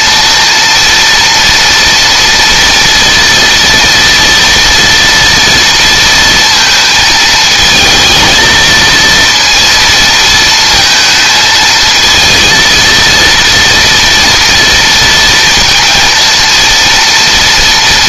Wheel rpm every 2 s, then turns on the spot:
240, 230, 230, 220, 230, 220, 230, 230, 230.
none